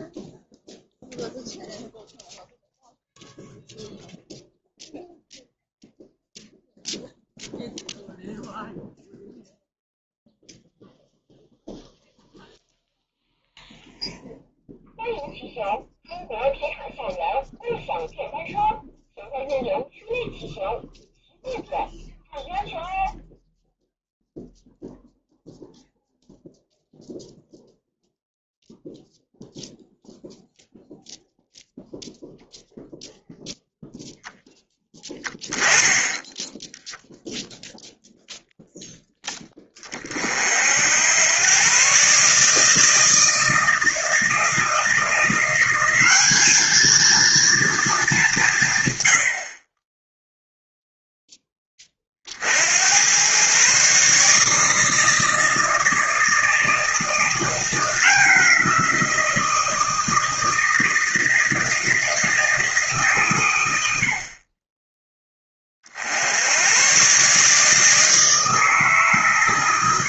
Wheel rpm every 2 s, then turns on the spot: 0, 0, 0, 0, 0, 0, 0, 0, 0, 0, 0, 0, 0, 0, 0, 0, 0, 10, 0, 0, 70, 160, 170, 220, 140, 0, 80, 150, 160, 170, 160, 160, 20, 110, 150.
none